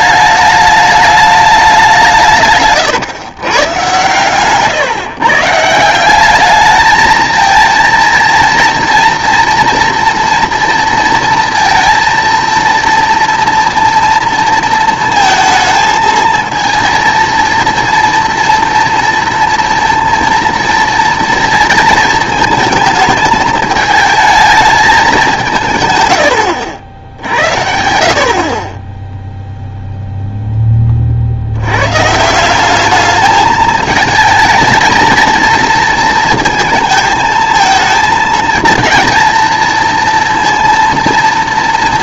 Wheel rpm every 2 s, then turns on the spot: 210, 140, 130, 210, 230, 230, 230, 230, 230, 230, 230, 220, 220, 80, 30, 10, 190, 220, 230, 220, 230.
none